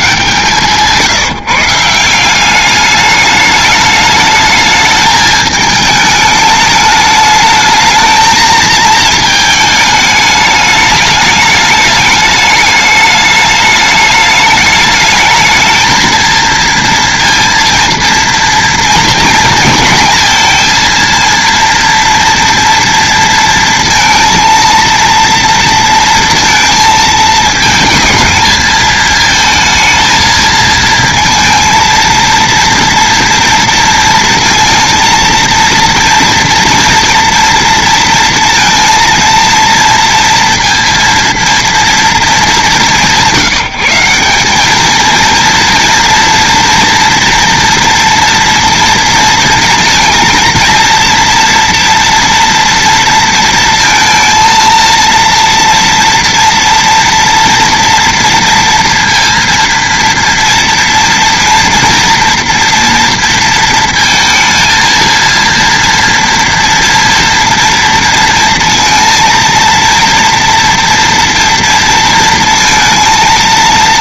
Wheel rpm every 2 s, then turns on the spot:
150, 210, 220, 210, 220, 210, 210, 220, 230, 230, 230, 230, 230, 220, 220, 230, 230, 230, 240, 230, 230, 180, 230, 230, 230, 230, 230, 230, 230, 230, 230, 230, 230, 230, 230, 230, 230.
none